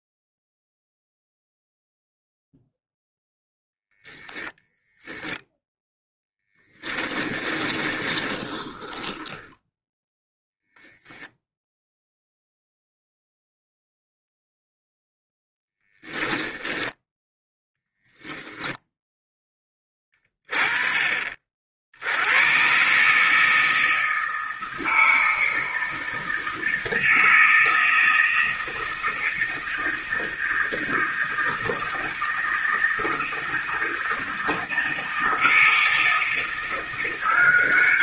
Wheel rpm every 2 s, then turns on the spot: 0, 0, 0, 10, 20, 0, 0, 0, 10, 0, 20, 130, 160, 160, 160, 160, 160, 160, 170.
6-10